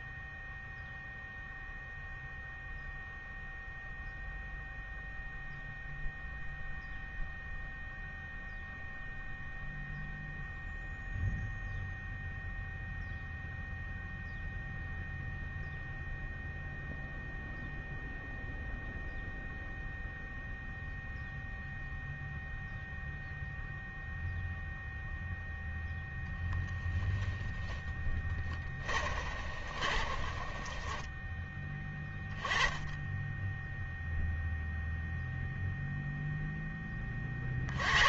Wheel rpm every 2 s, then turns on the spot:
0, 0, 0, 0, 0, 0, 0, 0, 0, 0, 0, 0, 0, 10, 30, 20, 10, 0, 10.
28-32